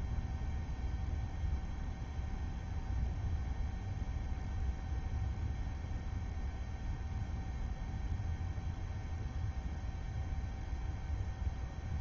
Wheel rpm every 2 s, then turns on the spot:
0, 0, 0, 0, 0, 0.
none